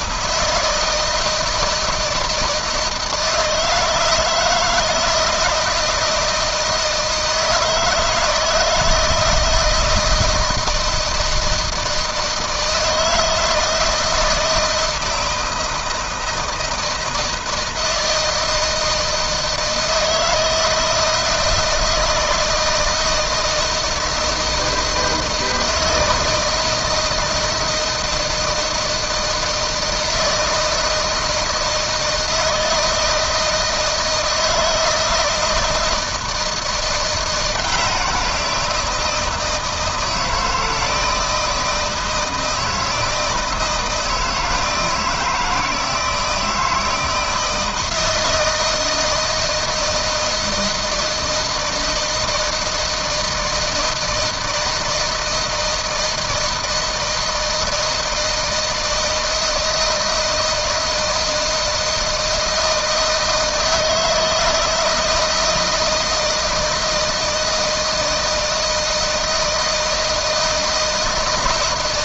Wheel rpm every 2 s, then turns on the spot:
160, 160, 160, 160, 160, 160, 160, 160, 160, 160, 160, 160, 160, 160, 160, 160, 160, 160, 170, 170, 160, 170, 160, 160, 160, 160, 160, 160, 160, 160, 160, 160, 160, 160, 160, 160.
none